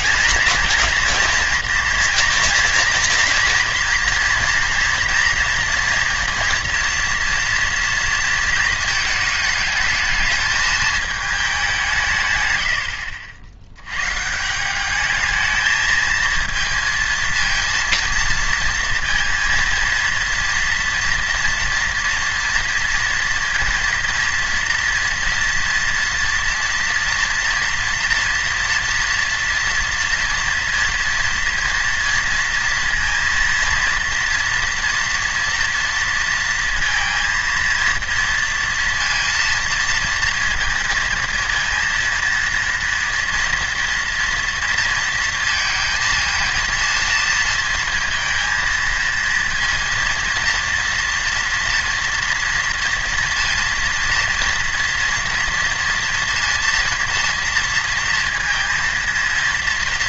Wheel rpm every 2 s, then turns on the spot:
220, 230, 230, 230, 230, 220, 90, 180, 230, 230, 230, 230, 230, 230, 230, 230, 230, 240, 230, 230, 230, 230, 230, 220, 230, 230, 230, 230, 230, 220.
none